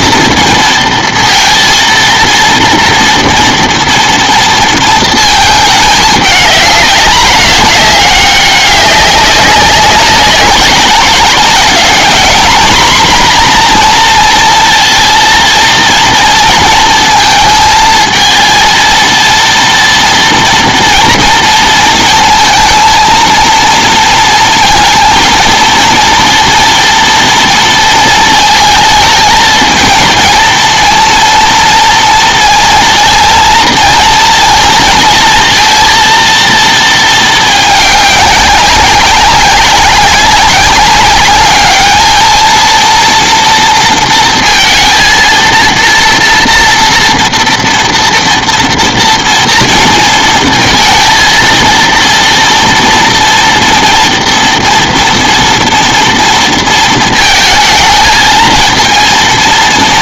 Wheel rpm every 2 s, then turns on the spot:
230, 240, 230, 210, 200, 200, 230, 230, 230, 230, 230, 230, 230, 230, 220, 220, 230, 230, 230, 200, 200, 220, 230, 230, 230, 230, 230, 230, 230, 230.
none